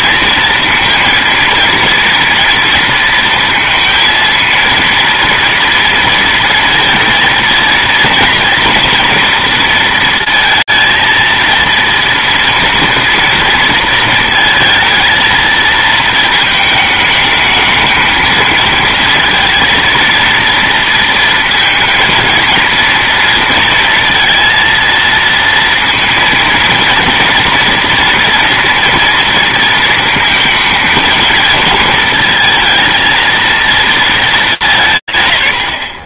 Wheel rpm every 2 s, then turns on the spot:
230, 230, 230, 230, 230, 230, 230, 230, 220, 230, 230, 230, 230, 230, 240, 220, 220, 180.
none